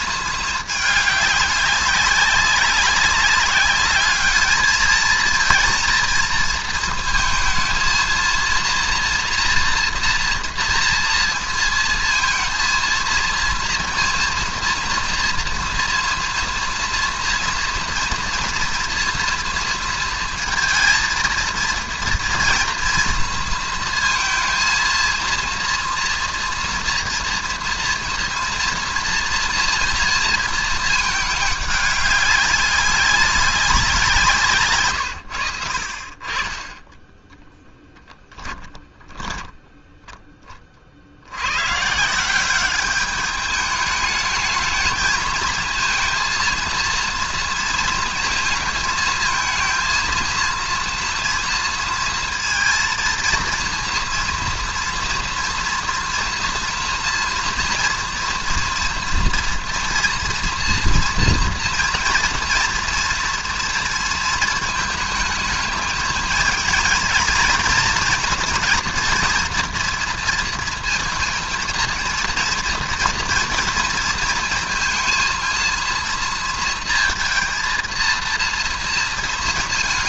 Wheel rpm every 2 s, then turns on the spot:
210, 200, 220, 220, 230, 230, 230, 230, 230, 240, 230, 230, 230, 230, 230, 220, 190, 130, 20, 10, 30, 200, 220, 230, 220, 230, 230, 230, 230, 240, 230, 230, 220, 230, 240, 230, 230, 230, 230, 230.
38-40